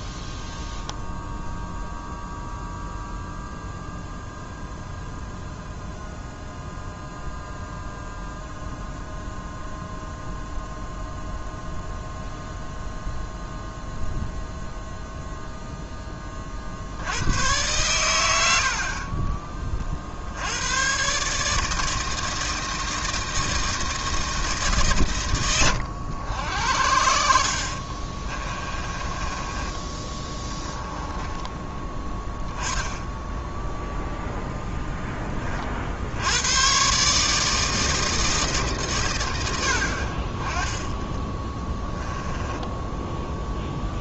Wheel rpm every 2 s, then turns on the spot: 0, 0, 0, 0, 0, 0, 0, 0, 60, 60, 100, 160, 140, 70, 20, 20, 10, 10, 120, 150, 20, 10.
28-32 42-44